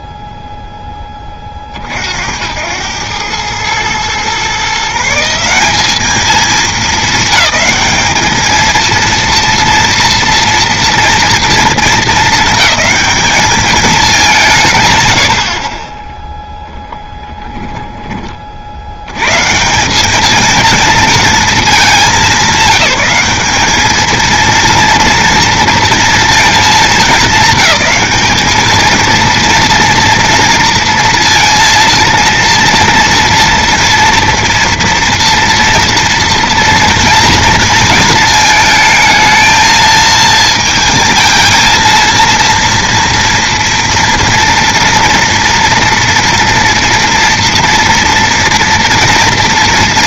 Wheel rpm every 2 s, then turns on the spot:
10, 70, 120, 200, 210, 240, 220, 200, 10, 40, 210, 200, 230, 220, 210, 230, 230, 230, 230, 220, 220, 230, 240, 230, 230.
none